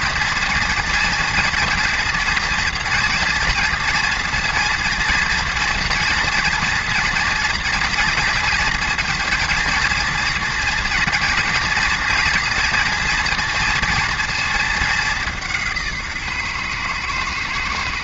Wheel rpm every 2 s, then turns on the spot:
230, 230, 230, 230, 230, 240, 230, 210, 120.
none